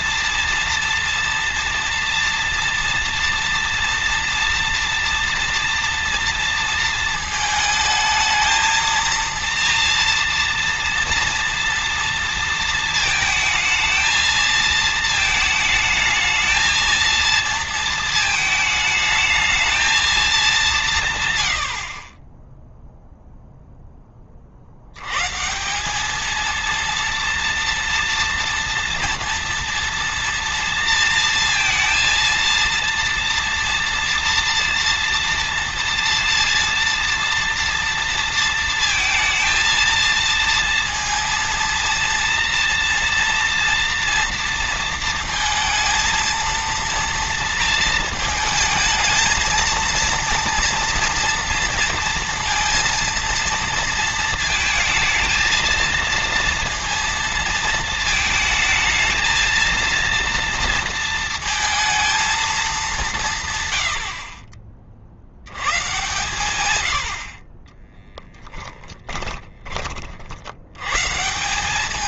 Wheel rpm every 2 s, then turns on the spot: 230, 230, 240, 230, 230, 230, 230, 220, 220, 220, 170, 0, 70, 230, 230, 230, 230, 230, 230, 230, 230, 230, 230, 230, 220, 230, 230, 220, 230, 220, 230, 210, 50, 100, 20, 100.
68-70